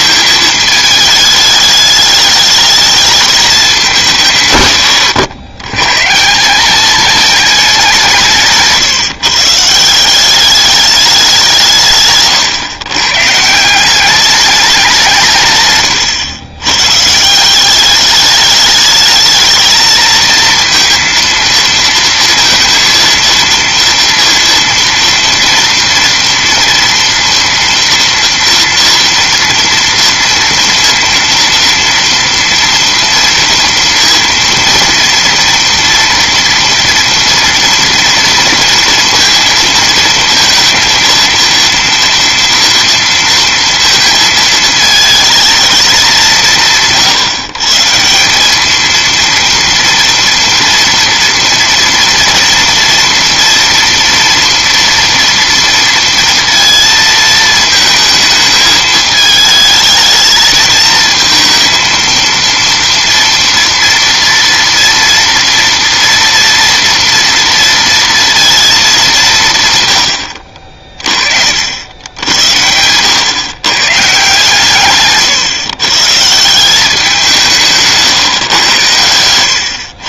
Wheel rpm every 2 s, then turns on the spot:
220, 210, 130, 200, 160, 200, 120, 190, 120, 210, 230, 230, 230, 230, 230, 230, 230, 230, 230, 230, 230, 230, 220, 160, 210, 230, 230, 230, 230, 220, 220, 230, 230, 230, 220, 50, 100, 140, 180, 120.
none